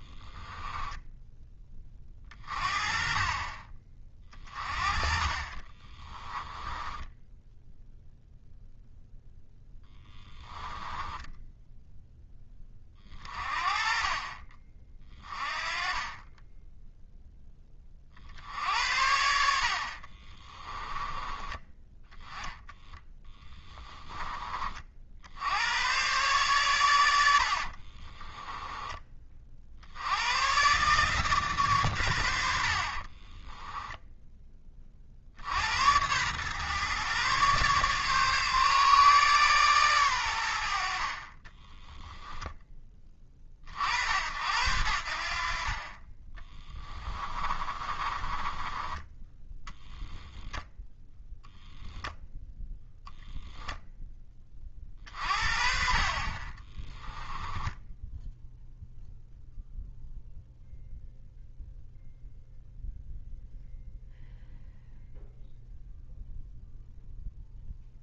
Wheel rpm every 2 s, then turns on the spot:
10, 30, 30, 10, 0, 10, 20, 40, 0, 70, 20, 10, 40, 110, 10, 130, 50, 30, 130, 140, 60, 20, 70, 20, 20, 10, 0, 40, 20, 0, 0, 0, 0, 0.
0-2 6-8 10-12 20-24 32-34 46-50 56-58